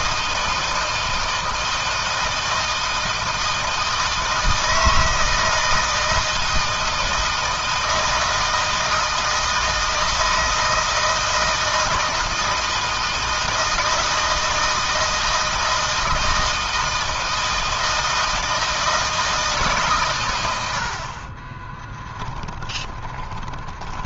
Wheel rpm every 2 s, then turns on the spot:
160, 160, 160, 160, 160, 160, 160, 160, 160, 160, 70, 10.
22-24